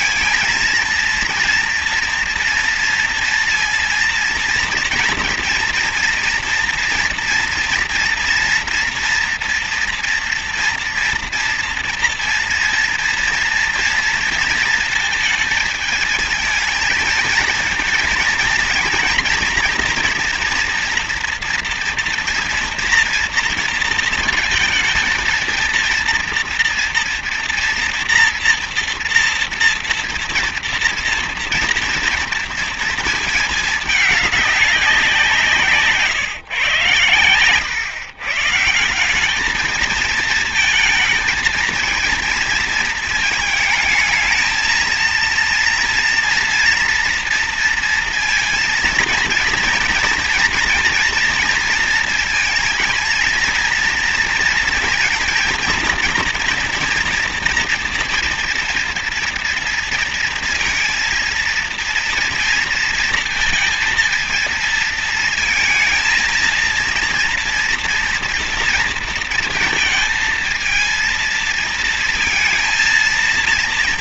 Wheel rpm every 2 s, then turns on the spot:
230, 230, 230, 240, 240, 240, 230, 230, 220, 230, 230, 230, 220, 230, 230, 230, 230, 200, 140, 160, 230, 230, 220, 240, 230, 230, 230, 230, 230, 240, 230, 230, 230, 230, 240, 220, 230.
none